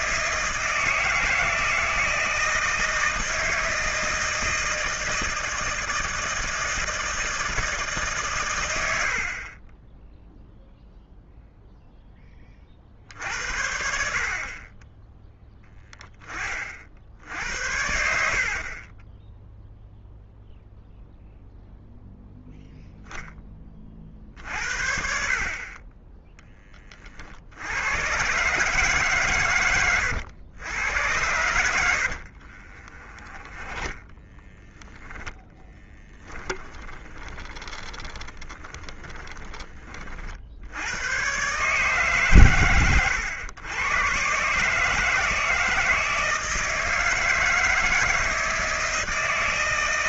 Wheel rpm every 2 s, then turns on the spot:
160, 160, 160, 160, 100, 0, 60, 20, 50, 30, 0, 0, 60, 30, 140, 100, 30, 10, 20, 30, 90, 110, 160, 160, 160.
32-34 36-40